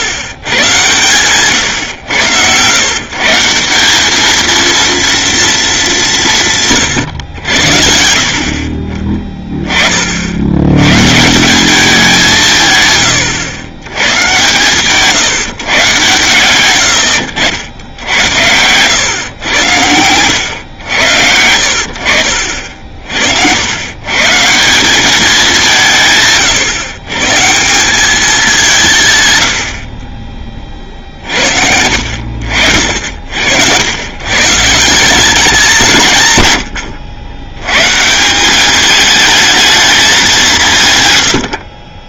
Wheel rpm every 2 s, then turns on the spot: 120, 100, 220, 140, 40, 90, 160, 130, 110, 100, 100, 50, 160, 140, 190, 30, 70, 150, 110, 200, 170.
26-28